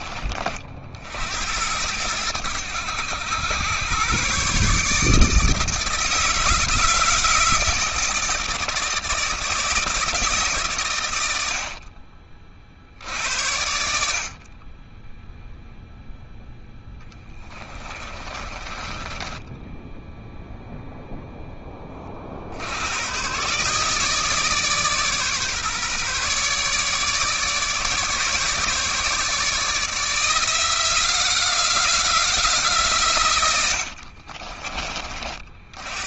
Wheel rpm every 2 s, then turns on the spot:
60, 90, 150, 160, 160, 110, 60, 10, 10, 20, 0, 90, 150, 150, 150, 180, 140, 40.
16-20